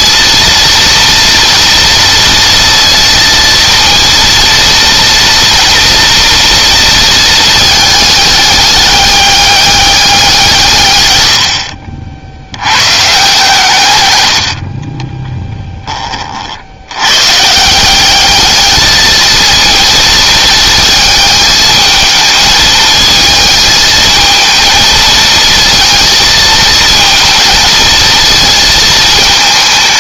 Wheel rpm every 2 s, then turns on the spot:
230, 230, 230, 230, 200, 130, 110, 30, 90, 210, 220, 220, 220, 230, 220.
none